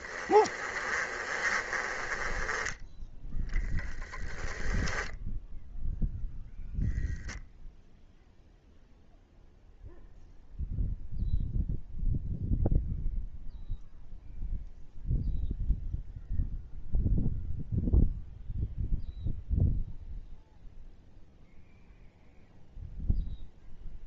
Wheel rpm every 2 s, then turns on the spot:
30, 10, 10, 0, 0, 0, 0, 0, 0, 0, 0, 0.
0-2 4-6